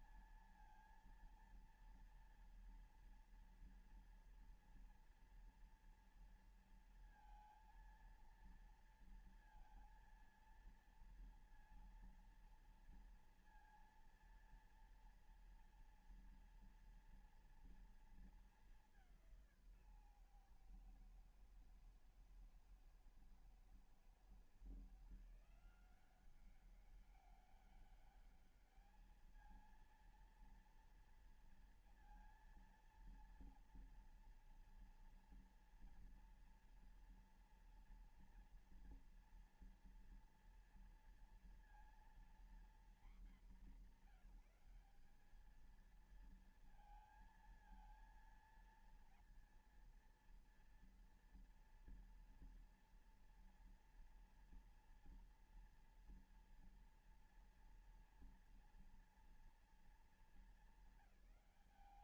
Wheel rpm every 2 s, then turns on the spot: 230, 230, 230, 230, 230, 230, 230, 230, 230, 200, 120, 110, 140, 190, 210, 230, 230, 230, 230, 230, 230, 240, 220, 230, 230, 230, 230, 230, 230, 230, 200.
none